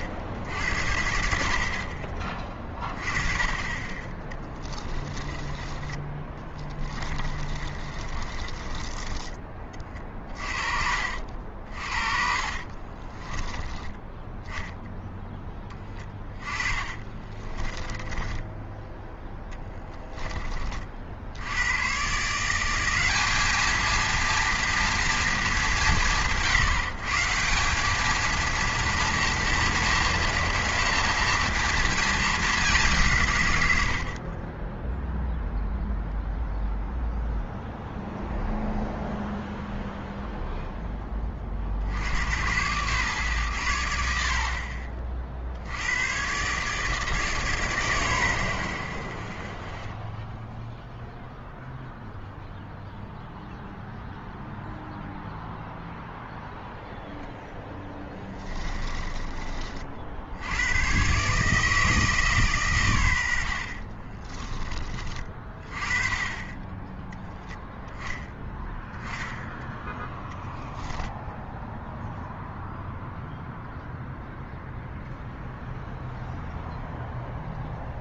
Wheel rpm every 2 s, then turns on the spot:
70, 20, 10, 20, 20, 50, 40, 0, 20, 10, 40, 180, 230, 150, 230, 230, 200, 20, 0, 0, 0, 110, 50, 150, 70, 0, 0, 0, 0, 20, 100, 120, 20, 10, 10, 10, 0, 0, 0.
4-10 12-14 16-20 58-60 70-72